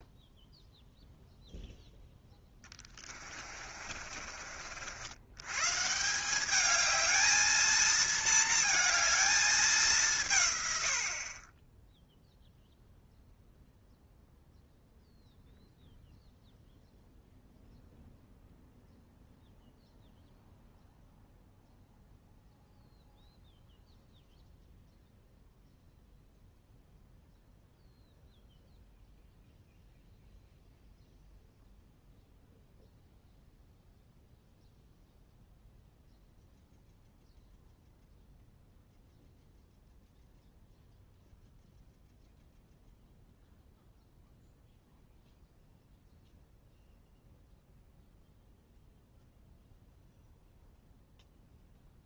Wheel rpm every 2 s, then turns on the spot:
0, 10, 50, 210, 220, 120, 0, 0, 0, 0, 0, 0, 0, 0, 0, 0, 0, 0, 0, 0, 0, 0, 0, 0, 0, 0.
2-4